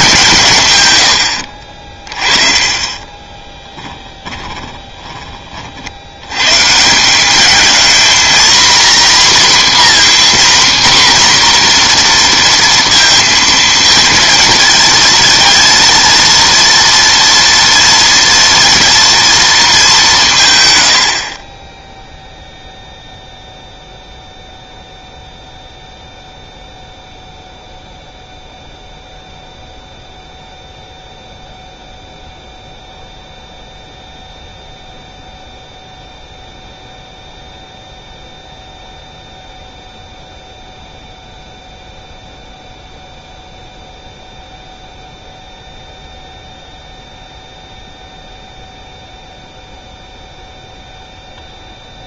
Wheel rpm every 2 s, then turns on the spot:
140, 30, 20, 140, 250, 260, 230, 230, 230, 230, 140, 0, 0, 0, 0, 0, 0, 0, 0, 0, 0, 0, 0, 0, 0, 0.
4-6